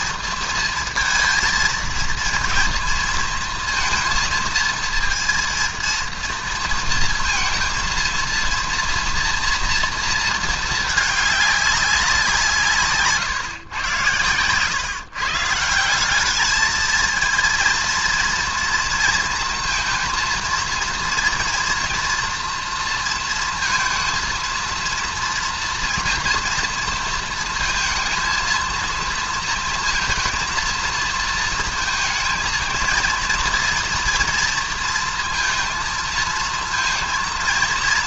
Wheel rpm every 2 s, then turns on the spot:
230, 230, 230, 230, 230, 230, 180, 120, 200, 230, 230, 230, 230, 240, 230, 230, 220, 230, 220.
none